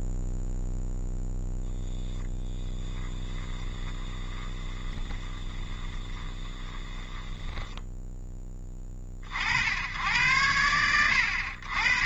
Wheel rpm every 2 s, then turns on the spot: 0, 10, 20, 20, 40, 80.
2-8